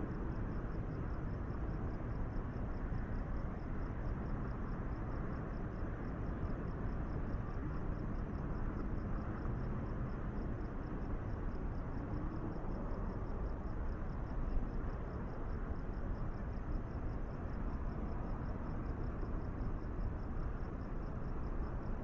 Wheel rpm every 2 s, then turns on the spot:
0, 0, 0, 0, 0, 0, 0, 0, 0, 0, 0.
none